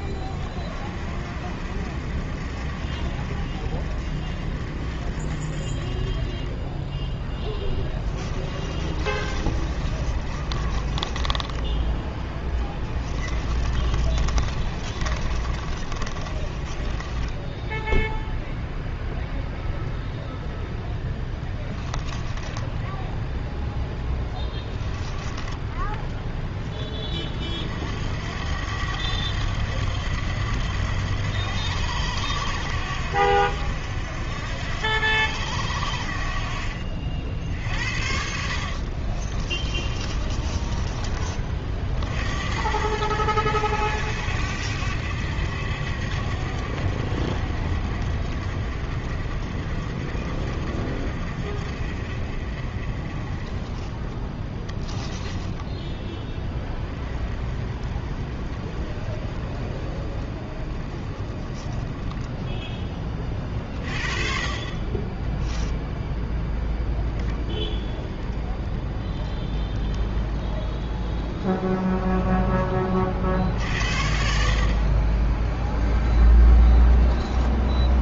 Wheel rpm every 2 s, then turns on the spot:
30, 50, 40, 20, 20, 20, 20, 30, 20, 0, 0, 10, 10, 10, 90, 90, 80, 80, 60, 60, 20, 70, 70, 60, 50, 50, 40, 10, 10, 30, 30, 10, 40, 0, 20, 20, 30, 50, 0.
8-18 22-26 38-42 54-56